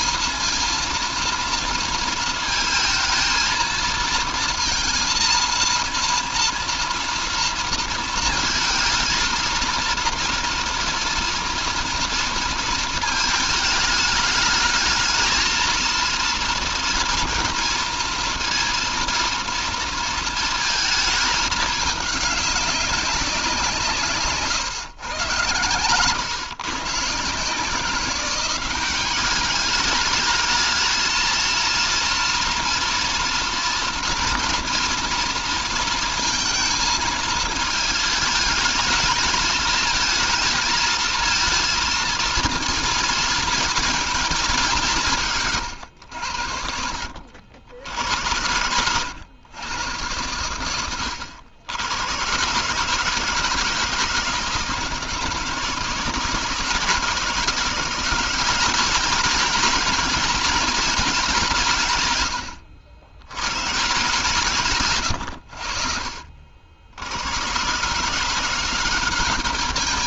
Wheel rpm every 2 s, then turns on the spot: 230, 230, 230, 230, 230, 230, 220, 220, 230, 230, 220, 190, 120, 150, 200, 220, 230, 230, 230, 210, 230, 230, 160, 60, 100, 90, 150, 160, 170, 200, 200, 100, 110, 80, 190.
none